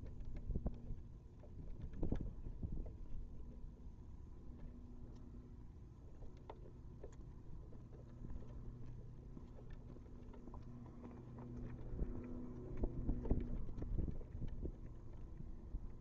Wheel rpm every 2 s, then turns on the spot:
0, 0, 0, 0, 0, 0, 0, 0.
none